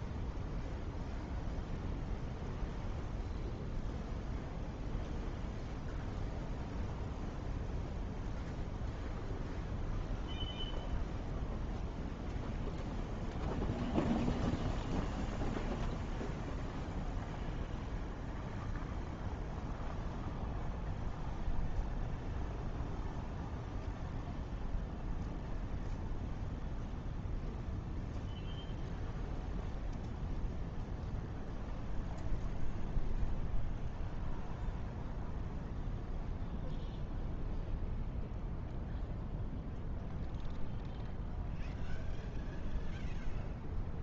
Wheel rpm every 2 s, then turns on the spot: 0, 0, 0, 0, 0, 0, 0, 0, 0, 0, 0, 0, 0, 0, 0, 0, 0, 0, 0, 0, 0, 0.
none